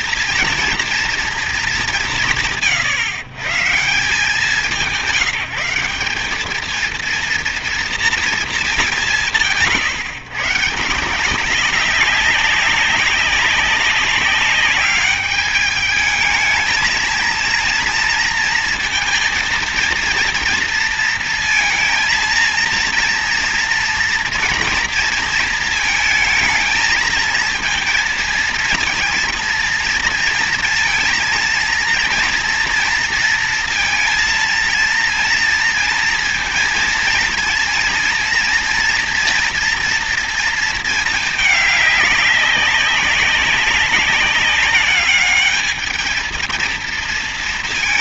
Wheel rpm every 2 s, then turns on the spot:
240, 140, 190, 220, 190, 160, 200, 200, 220, 230, 230, 230, 230, 220, 230, 230, 230, 230, 230, 230, 220, 200, 200, 230.
none